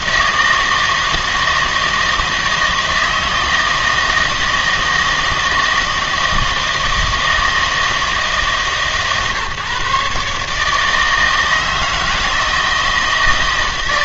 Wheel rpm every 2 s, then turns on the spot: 160, 160, 160, 160, 150, 150, 160.
none